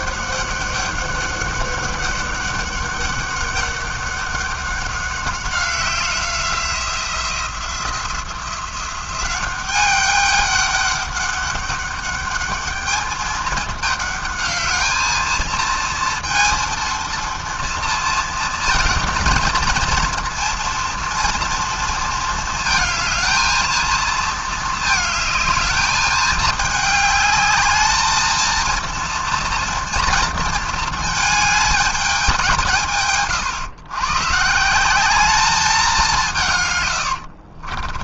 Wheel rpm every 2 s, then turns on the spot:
200, 200, 200, 180, 180, 200, 210, 210, 230, 230, 230, 220, 220, 210, 230, 230, 170, 160, 140.
none